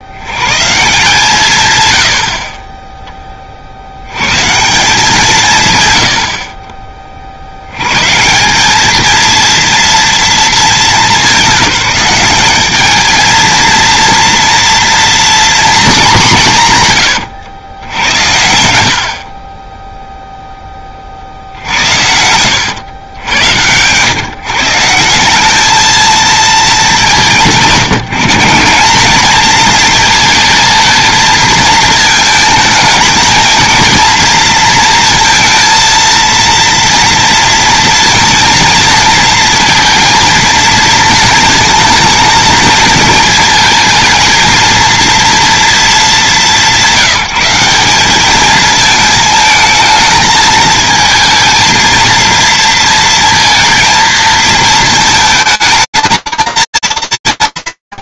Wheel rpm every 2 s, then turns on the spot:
160, 10, 170, 40, 220, 190, 220, 240, 130, 60, 40, 90, 170, 180, 210, 220, 220, 230, 230, 230, 220, 220, 230, 180, 220, 220, 230, 220, 190.
none